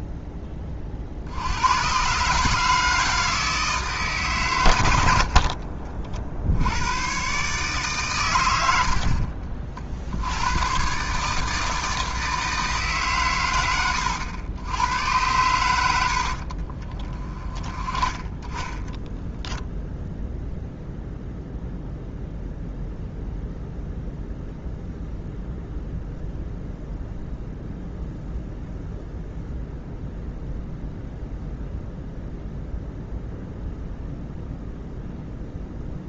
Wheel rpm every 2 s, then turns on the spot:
30, 150, 110, 80, 80, 110, 150, 90, 40, 10, 0, 0, 0, 0, 0, 0, 0, 0.
16-20